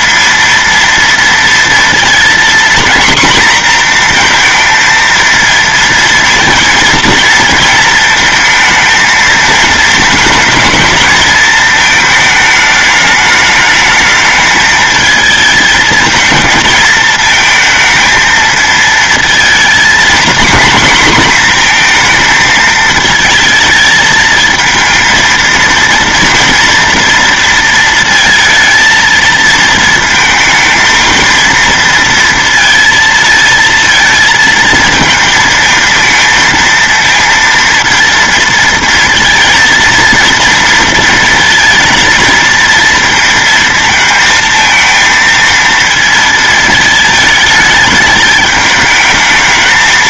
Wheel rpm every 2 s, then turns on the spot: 230, 240, 230, 230, 220, 220, 210, 220, 230, 230, 240, 220, 230, 230, 230, 220, 230, 220, 230, 230, 230, 230, 230, 220, 210.
none